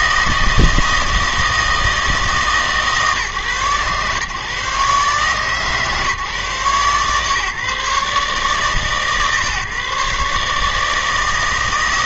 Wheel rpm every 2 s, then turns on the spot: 160, 140, 140, 130, 150, 150.
none